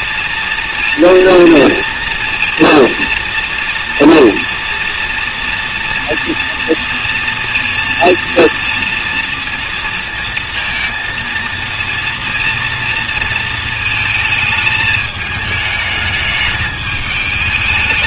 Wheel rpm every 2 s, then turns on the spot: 230, 230, 230, 230, 230, 230, 230, 220, 210.
none